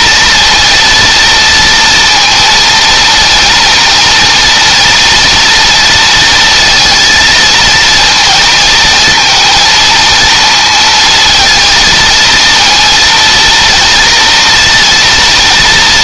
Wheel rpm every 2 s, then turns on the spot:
240, 230, 230, 230, 230, 230, 230, 240.
none